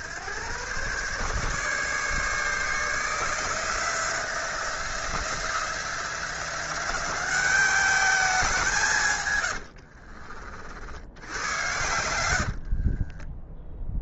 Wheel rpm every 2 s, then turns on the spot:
120, 160, 170, 190, 160, 70, 40.
12-14